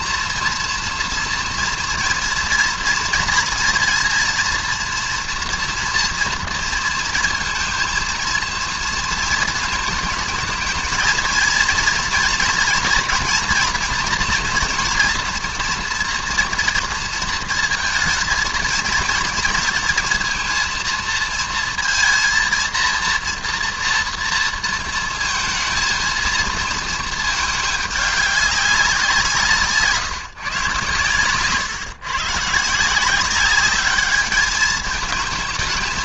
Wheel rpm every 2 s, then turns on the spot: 240, 240, 230, 230, 230, 230, 240, 240, 230, 230, 230, 230, 230, 220, 190, 130, 150, 220.
none